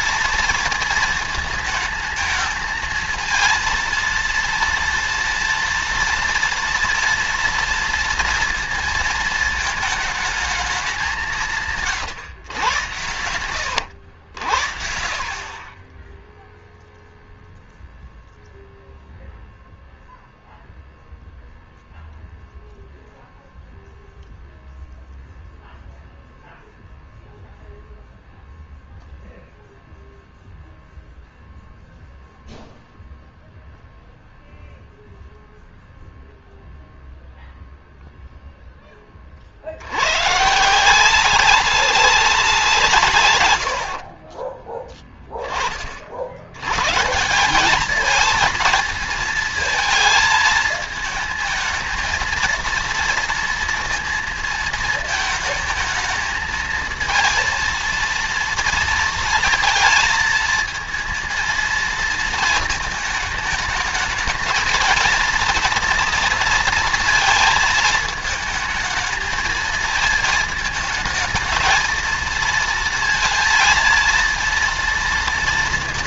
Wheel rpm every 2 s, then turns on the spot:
230, 220, 230, 230, 230, 210, 120, 80, 0, 0, 0, 0, 0, 0, 0, 0, 0, 0, 0, 0, 150, 180, 30, 90, 220, 220, 230, 230, 220, 230, 230, 220, 220, 230, 220, 220, 230, 230.
44-46